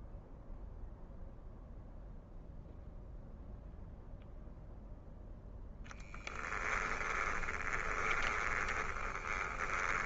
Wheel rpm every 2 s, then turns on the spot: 0, 0, 0, 10, 20.
6-10